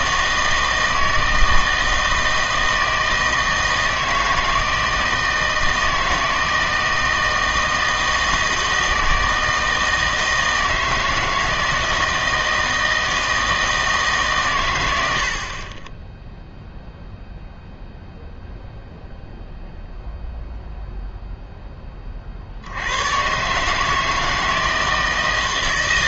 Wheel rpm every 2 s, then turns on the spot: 160, 160, 160, 160, 160, 160, 160, 110, 0, 0, 0, 70, 160.
none